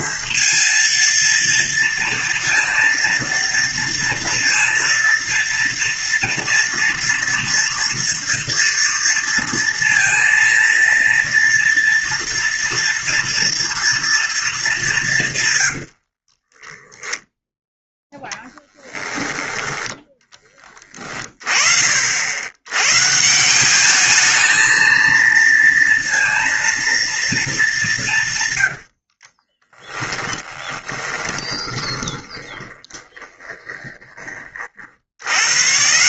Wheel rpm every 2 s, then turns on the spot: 230, 230, 230, 230, 230, 230, 230, 190, 10, 10, 30, 130, 230, 230, 90, 20, 20, 60.
16-18 28-34